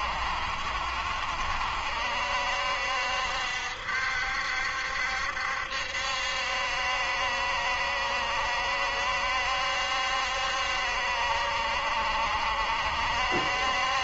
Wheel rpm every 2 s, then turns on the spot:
60, 70, 70, 70, 70, 70, 70.
none